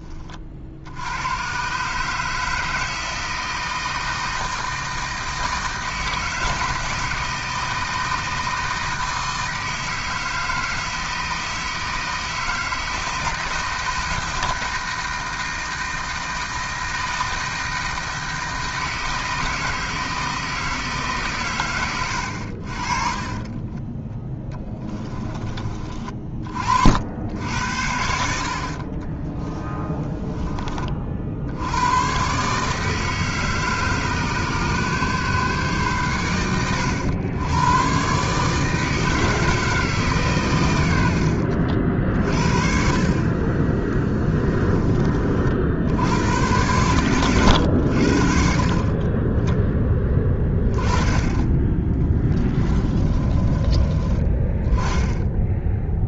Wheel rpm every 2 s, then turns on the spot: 50, 160, 160, 160, 160, 160, 160, 160, 160, 160, 160, 50, 10, 60, 40, 20, 150, 140, 100, 160, 90, 50, 30, 110, 30, 20, 20, 10.
24-26 52-54